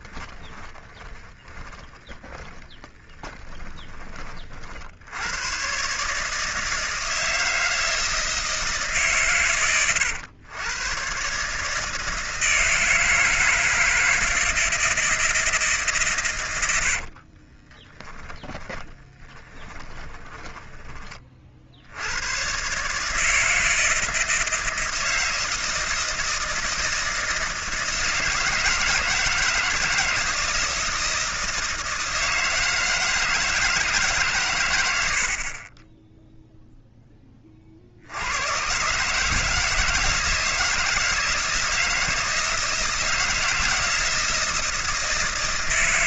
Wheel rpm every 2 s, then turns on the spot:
10, 10, 60, 160, 150, 120, 160, 160, 90, 20, 20, 140, 160, 160, 160, 160, 160, 110, 0, 120, 160, 160, 160.
0-4 16-20